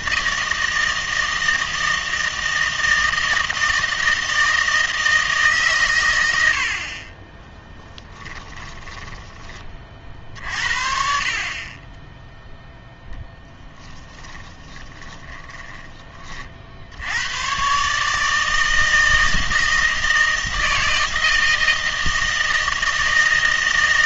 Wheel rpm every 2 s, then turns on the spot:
160, 160, 160, 80, 10, 60, 0, 10, 50, 160, 160, 160.
8-10 14-16